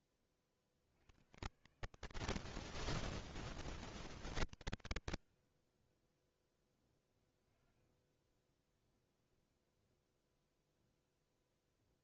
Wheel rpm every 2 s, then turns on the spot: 50, 30, 70, 0, 10, 0.
8-10